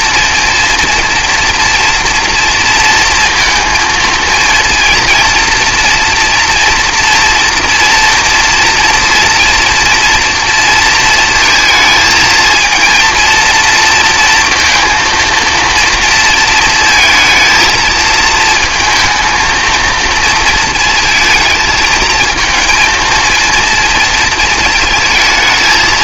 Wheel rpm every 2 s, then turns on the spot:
230, 230, 230, 240, 230, 230, 230, 230, 230, 220, 230, 230, 230.
none